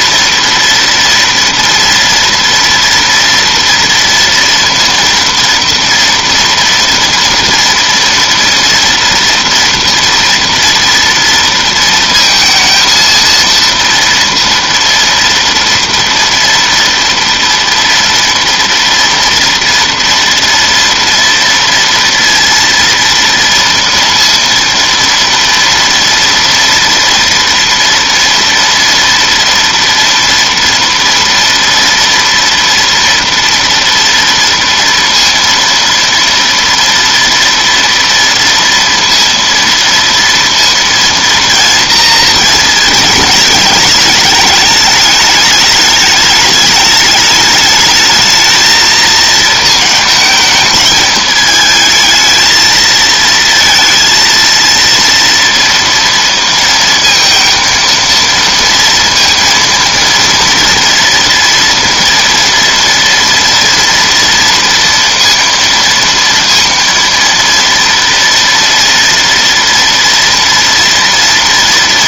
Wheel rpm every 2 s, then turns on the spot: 230, 230, 230, 230, 240, 230, 230, 230, 230, 230, 230, 230, 230, 230, 230, 230, 230, 230, 230, 230, 230, 220, 210, 210, 220, 220, 220, 230, 230, 230, 230, 230, 230, 230, 230, 230.
none